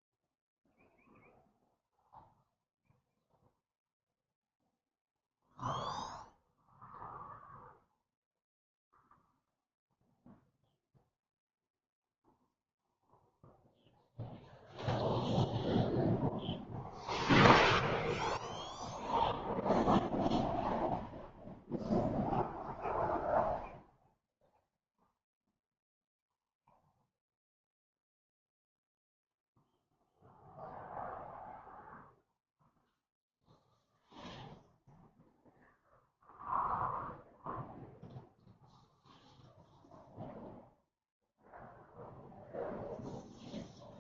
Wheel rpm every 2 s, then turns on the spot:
0, 0, 0, 0, 0, 0, 0, 0, 0, 0, 0, 0, 0, 0, 0, 0, 0, 0, 0, 0, 0, 0.
none